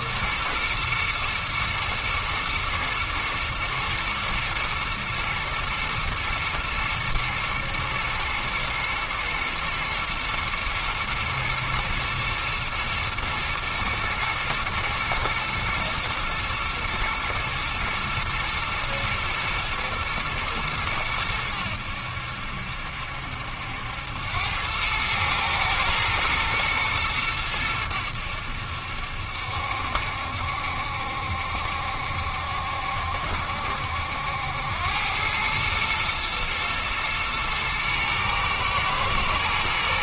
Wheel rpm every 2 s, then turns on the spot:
120, 120, 120, 110, 110, 110, 110, 110, 110, 110, 110, 70, 100, 110, 80, 70, 70, 90, 110, 110.
none